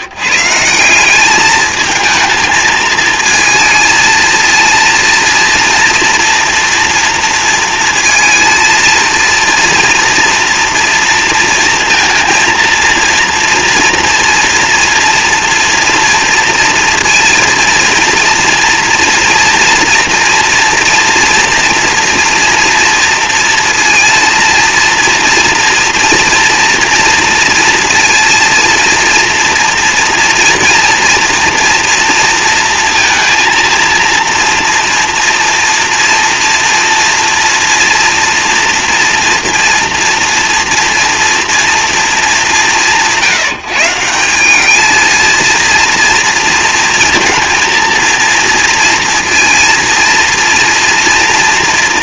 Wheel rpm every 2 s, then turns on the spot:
170, 220, 230, 230, 230, 230, 230, 230, 230, 230, 230, 230, 230, 230, 230, 230, 230, 230, 230, 230, 230, 190, 210, 230, 230, 230.
none